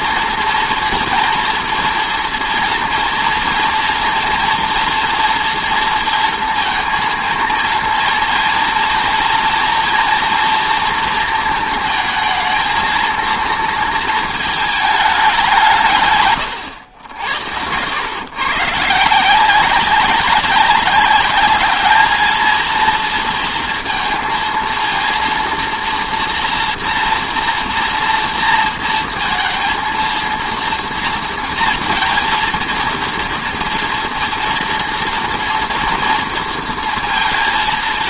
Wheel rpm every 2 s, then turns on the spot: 240, 230, 230, 230, 230, 230, 220, 220, 100, 130, 190, 220, 230, 230, 230, 230, 230, 230, 230.
none